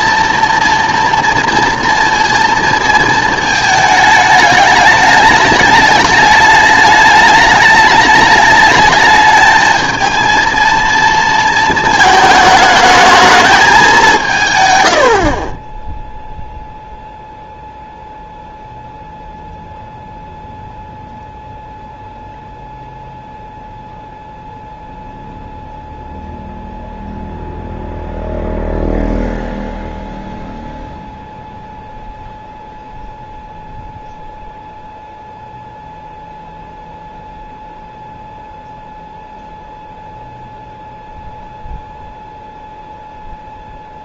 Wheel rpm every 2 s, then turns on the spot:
230, 230, 210, 210, 210, 230, 210, 110, 0, 0, 0, 0, 0, 0, 0, 0, 0, 0, 0, 0, 0, 0.
none